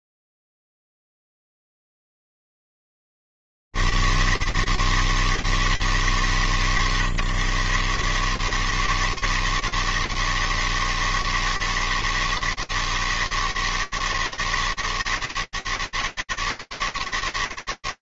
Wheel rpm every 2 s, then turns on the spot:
90, 160, 160, 130, 150, 160, 160, 160, 160.
none